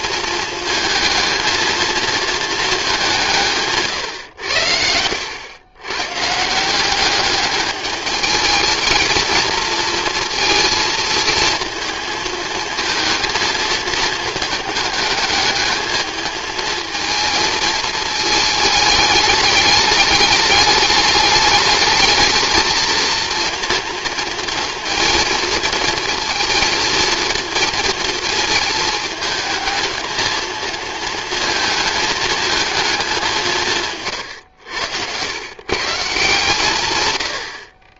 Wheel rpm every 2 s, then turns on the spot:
220, 220, 90, 170, 220, 230, 220, 220, 220, 220, 210, 220, 230, 230, 220, 220, 220, 100, 150.
34-36